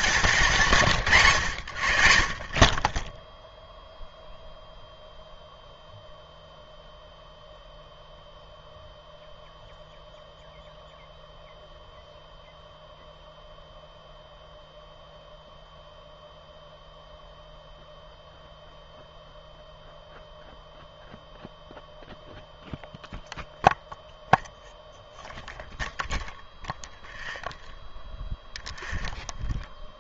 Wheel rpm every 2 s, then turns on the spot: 150, 20, 0, 0, 0, 0, 0, 0, 0, 0, 0, 0, 0, 0, 0.
0-2